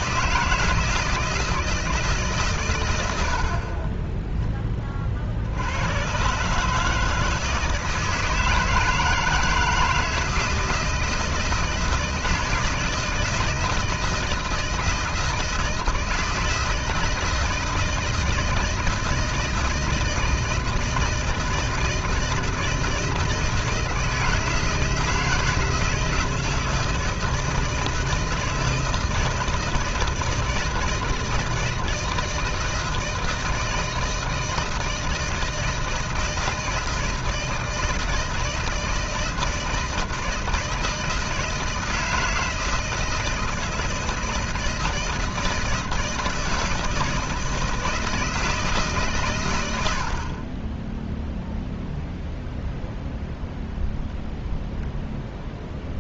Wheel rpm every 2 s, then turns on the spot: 160, 90, 30, 160, 160, 160, 160, 160, 160, 160, 160, 160, 160, 160, 160, 160, 160, 160, 160, 160, 160, 160, 160, 160, 150, 0, 0, 0.
none